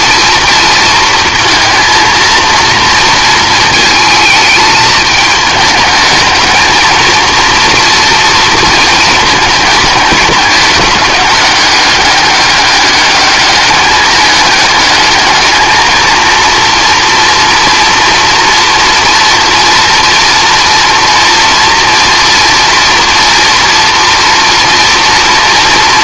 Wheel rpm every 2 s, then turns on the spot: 230, 230, 220, 220, 230, 210, 200, 210, 230, 230, 230, 230, 230.
none